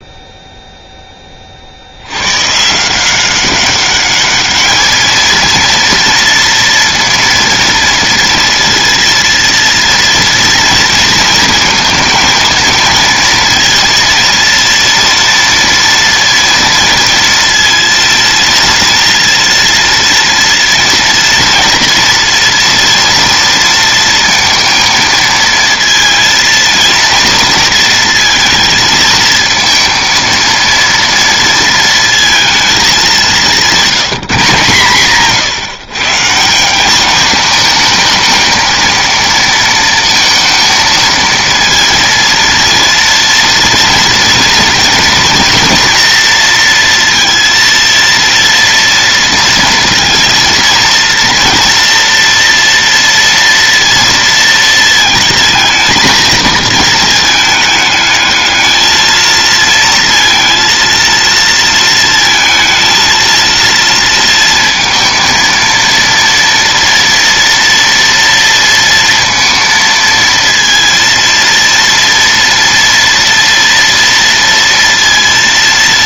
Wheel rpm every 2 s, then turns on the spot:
0, 140, 210, 230, 230, 230, 220, 230, 230, 230, 230, 230, 230, 230, 230, 230, 220, 150, 180, 220, 230, 230, 230, 230, 230, 230, 230, 220, 220, 220, 230, 230, 230, 230, 230, 230, 230, 230.
none